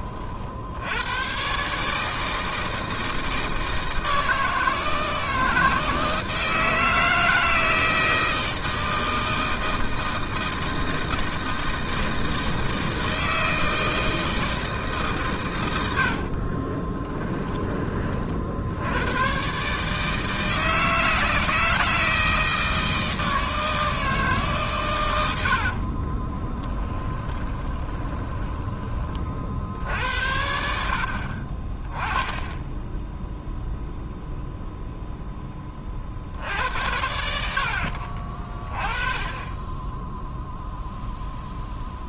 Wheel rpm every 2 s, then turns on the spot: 80, 160, 160, 160, 160, 160, 160, 150, 20, 80, 160, 160, 130, 20, 20, 70, 10, 0, 70, 20, 0.
16-18 26-28